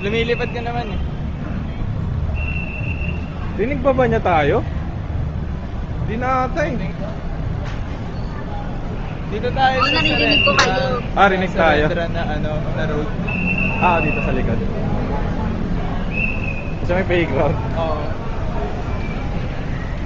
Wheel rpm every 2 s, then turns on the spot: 0, 0, 0, 0, 0, 0, 0, 0, 0, 0.
none